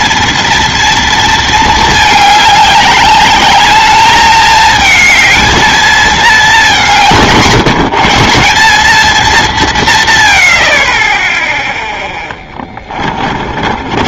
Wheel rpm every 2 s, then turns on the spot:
220, 210, 220, 140, 200, 10, 40.
12-14